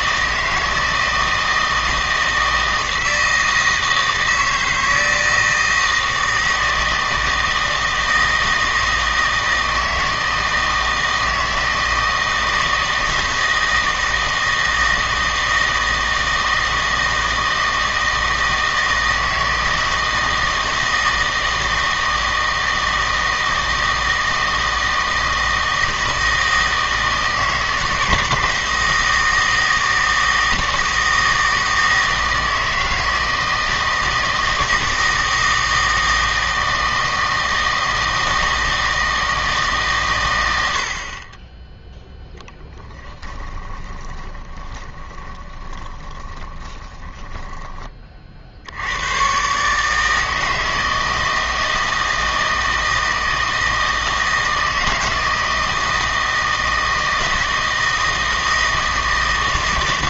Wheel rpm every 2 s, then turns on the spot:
160, 160, 160, 160, 160, 160, 160, 160, 160, 160, 160, 160, 160, 160, 160, 160, 160, 160, 160, 160, 80, 10, 20, 20, 70, 160, 160, 160, 160, 160.
42-48